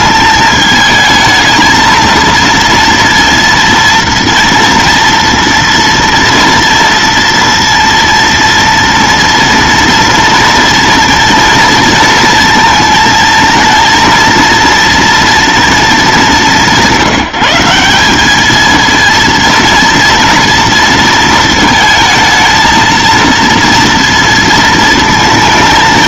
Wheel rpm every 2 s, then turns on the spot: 220, 230, 230, 230, 230, 230, 230, 230, 160, 220, 230, 220, 230.
none